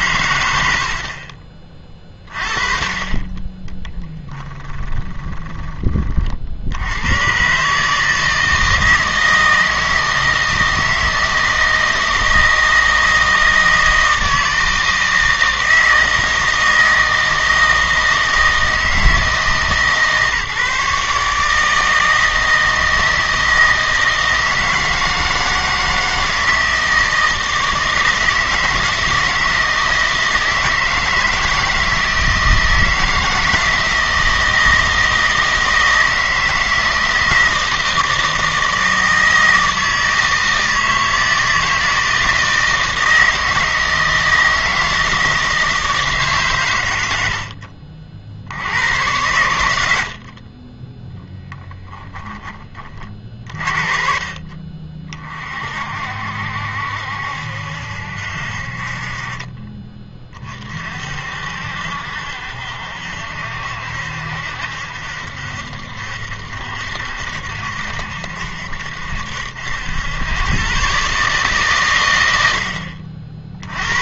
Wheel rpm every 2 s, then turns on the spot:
80, 40, 20, 70, 160, 160, 160, 160, 160, 160, 150, 160, 160, 160, 160, 160, 160, 160, 160, 160, 160, 160, 160, 110, 80, 30, 30, 40, 70, 50, 40, 60, 70, 70, 70, 120, 70.
4-6